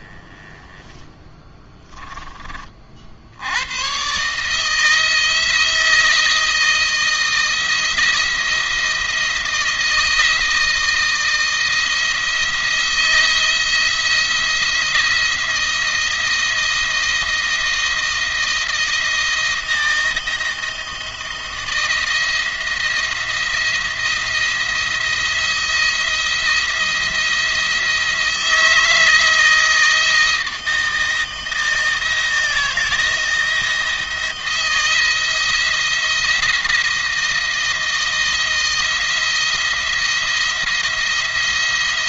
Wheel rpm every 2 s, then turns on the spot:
20, 40, 160, 160, 160, 160, 170, 170, 160, 170, 170, 170, 170, 170, 160, 160, 160, 160, 160, 160, 170.
none